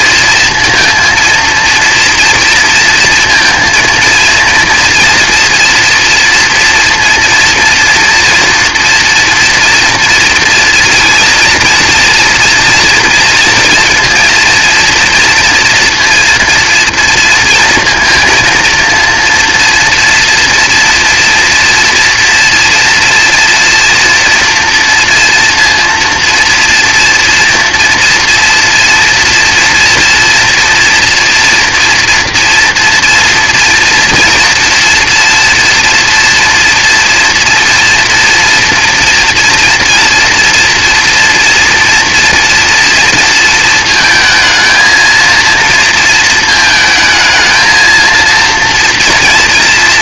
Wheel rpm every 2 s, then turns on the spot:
230, 230, 230, 230, 230, 230, 230, 230, 230, 230, 230, 240, 230, 240, 230, 240, 240, 230, 230, 230, 240, 230, 230, 220, 240.
none